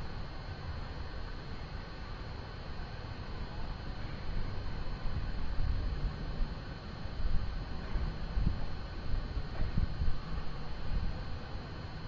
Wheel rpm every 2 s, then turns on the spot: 0, 0, 0, 0, 0, 0.
none